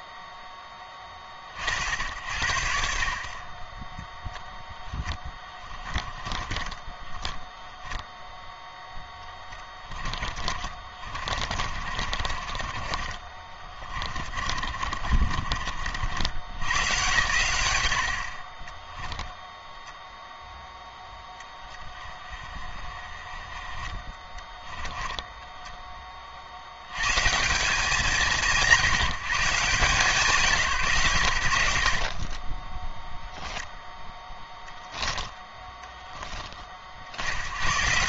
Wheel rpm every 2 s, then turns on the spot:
10, 70, 10, 20, 10, 40, 30, 40, 130, 10, 0, 30, 10, 100, 160, 110, 0, 10, 50.
4-8 10-12 14-16 18-20 24-26 34-36